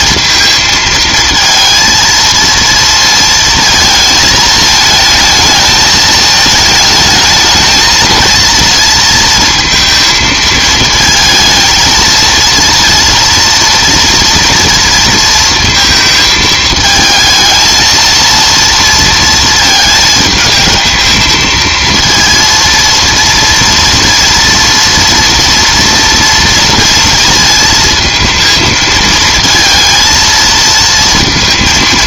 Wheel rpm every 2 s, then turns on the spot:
230, 230, 220, 220, 230, 220, 230, 230, 220, 230, 220, 230, 230, 230, 230, 230.
none